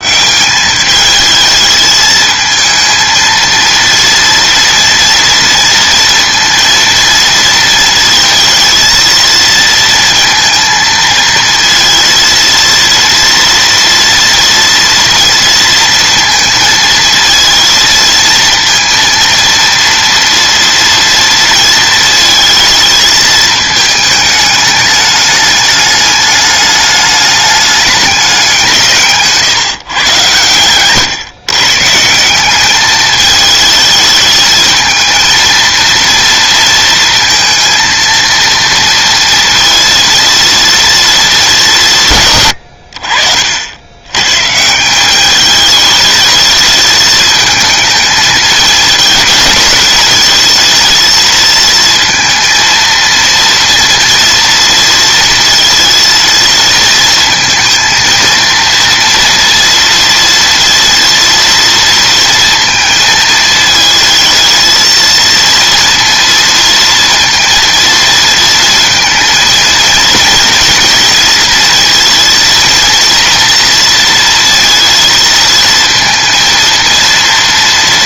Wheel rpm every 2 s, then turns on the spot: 210, 230, 230, 230, 230, 230, 230, 230, 230, 230, 230, 220, 210, 210, 160, 120, 210, 220, 230, 230, 230, 80, 160, 220, 210, 220, 230, 230, 220, 230, 230, 230, 230, 230, 230, 230, 230, 230, 230.
none